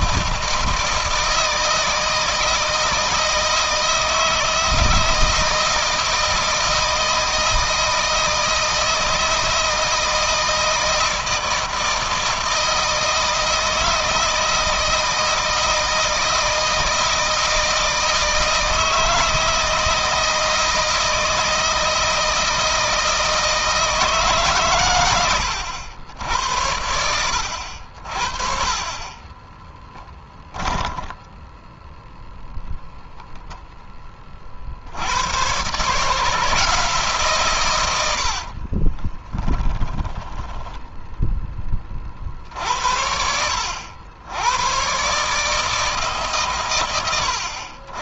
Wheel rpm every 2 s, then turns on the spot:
160, 160, 160, 160, 160, 160, 160, 160, 160, 160, 160, 160, 120, 80, 40, 10, 0, 70, 160, 40, 10, 60, 120, 120.
28-32 38-42